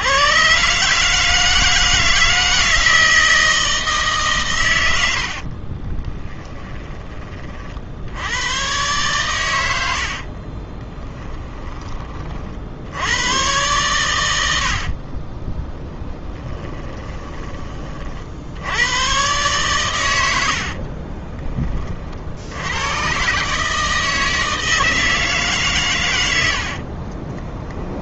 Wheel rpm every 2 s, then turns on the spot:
140, 160, 100, 20, 120, 20, 80, 60, 20, 90, 50, 110, 160, 60.
10-12 14-18 20-22 26-28